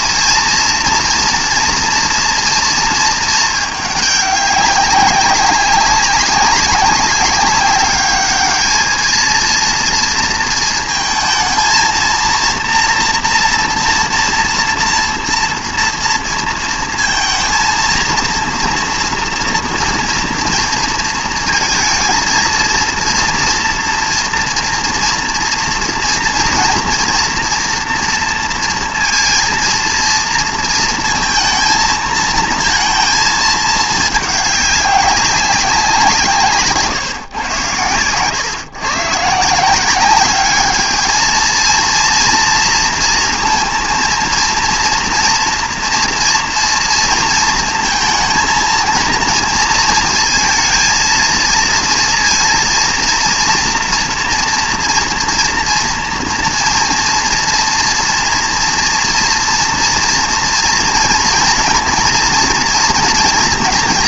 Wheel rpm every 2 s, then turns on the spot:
240, 230, 200, 200, 220, 230, 230, 230, 230, 230, 230, 230, 230, 240, 230, 230, 230, 200, 150, 130, 210, 230, 230, 230, 230, 230, 230, 230, 230, 230, 230, 230.
none